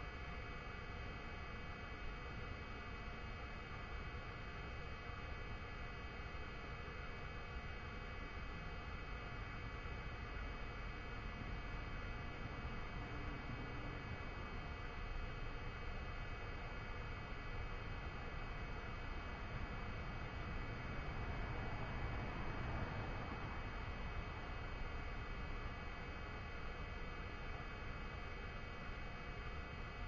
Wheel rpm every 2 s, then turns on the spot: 0, 0, 0, 0, 0, 0, 0, 0, 0, 0, 0, 0, 0, 0, 0.
none